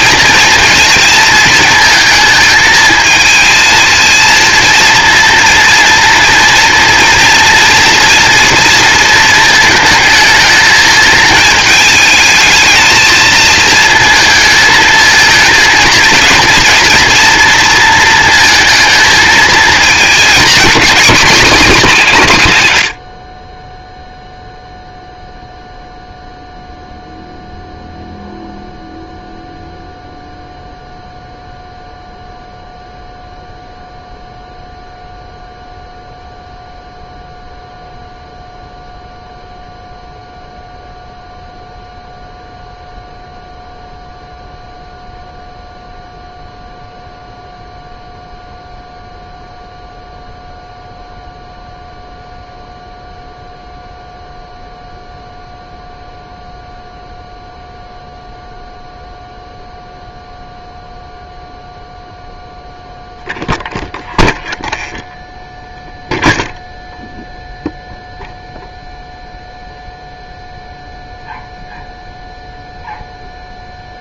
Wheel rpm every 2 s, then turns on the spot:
220, 220, 230, 230, 230, 220, 220, 220, 240, 230, 240, 110, 0, 0, 0, 0, 0, 0, 0, 0, 0, 0, 0, 0, 0, 0, 0, 0, 0, 0, 0, 0, 0, 0, 0, 0, 0.
none